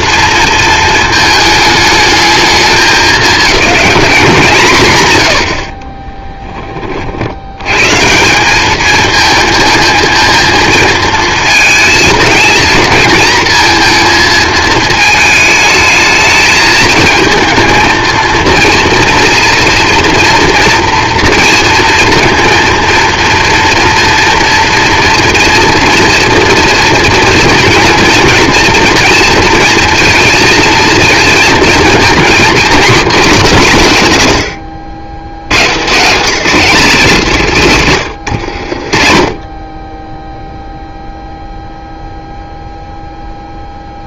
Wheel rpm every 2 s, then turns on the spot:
230, 210, 180, 30, 200, 230, 220, 220, 220, 230, 230, 230, 240, 240, 230, 230, 240, 120, 210, 70, 0, 0.
none